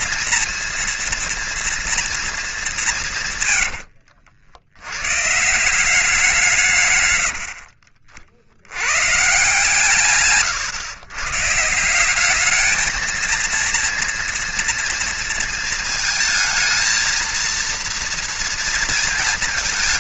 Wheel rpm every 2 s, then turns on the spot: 230, 220, 80, 170, 60, 130, 200, 230, 220, 230.
none